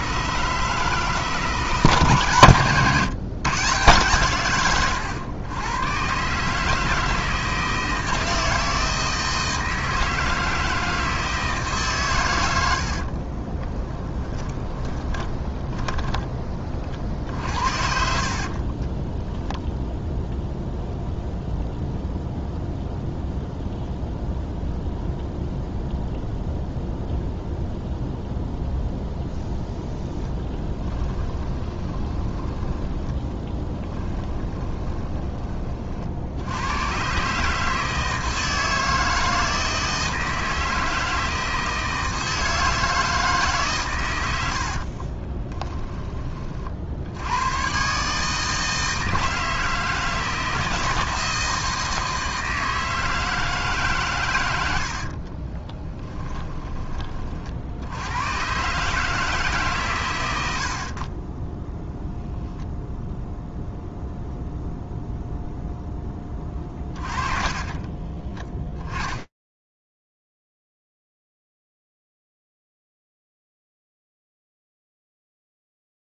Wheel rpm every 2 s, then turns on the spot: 160, 130, 130, 160, 160, 160, 70, 20, 40, 30, 0, 0, 0, 0, 0, 10, 20, 20, 110, 160, 160, 160, 50, 70, 160, 160, 160, 60, 30, 150, 70, 0, 0, 30, 10, 0, 0, 0.
12-16 18-20 30-36 44-46 54-56